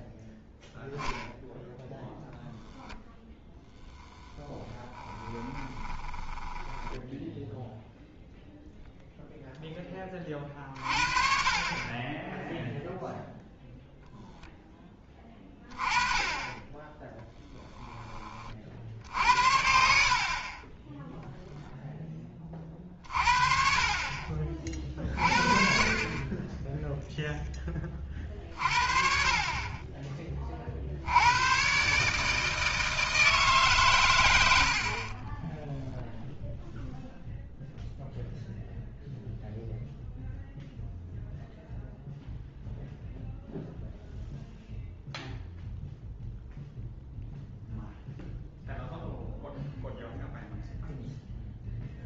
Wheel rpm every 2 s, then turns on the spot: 0, 0, 10, 10, 0, 40, 0, 10, 20, 50, 20, 30, 40, 10, 50, 50, 160, 80, 0, 0, 0, 0, 0, 0, 0, 0.
4-8